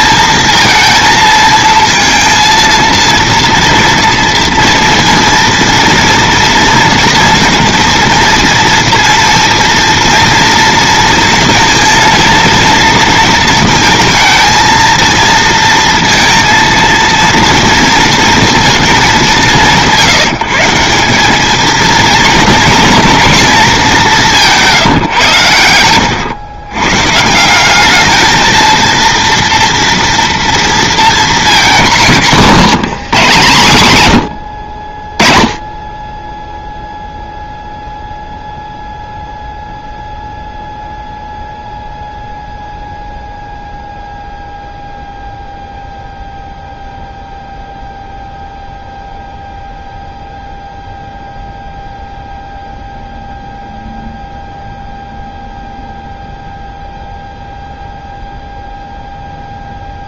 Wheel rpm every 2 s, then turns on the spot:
220, 230, 230, 240, 230, 230, 230, 230, 230, 230, 170, 220, 170, 110, 230, 230, 210, 70, 0, 0, 0, 0, 0, 0, 0, 0, 0, 0, 0, 0.
none